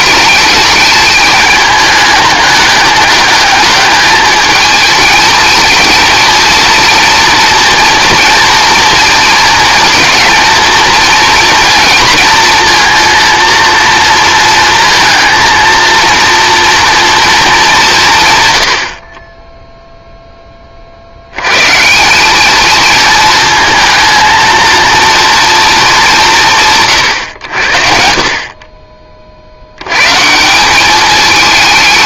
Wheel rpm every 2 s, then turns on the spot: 210, 210, 220, 230, 230, 230, 230, 230, 230, 70, 50, 220, 230, 110, 30, 200.
none